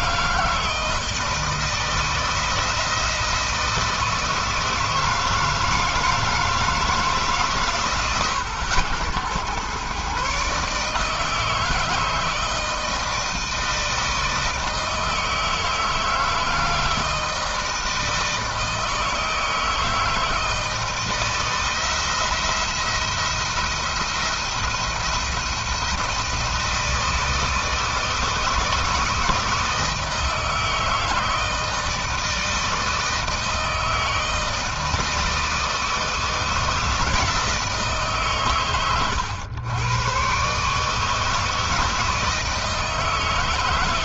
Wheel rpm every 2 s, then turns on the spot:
160, 170, 160, 150, 90, 150, 160, 160, 160, 160, 160, 170, 170, 160, 160, 160, 160, 160, 160, 120, 150, 160.
none